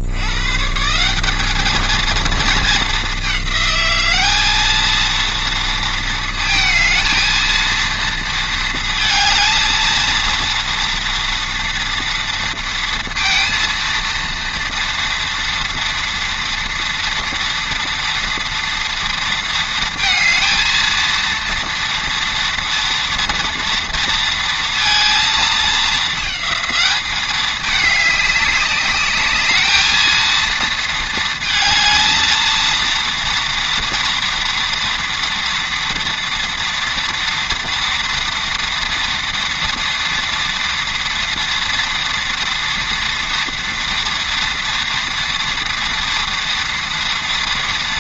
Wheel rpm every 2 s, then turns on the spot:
130, 230, 200, 220, 230, 230, 230, 230, 230, 230, 230, 230, 230, 210, 200, 220, 220, 230, 230, 230, 230, 230, 230, 230.
none